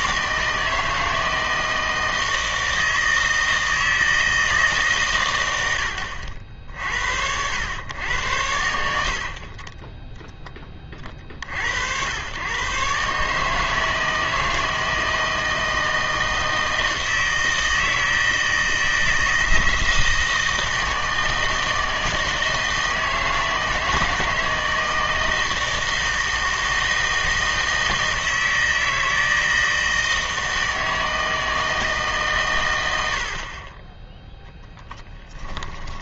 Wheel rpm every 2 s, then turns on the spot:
160, 160, 160, 60, 80, 20, 130, 160, 160, 160, 160, 160, 160, 160, 160, 160, 110, 10.
34-36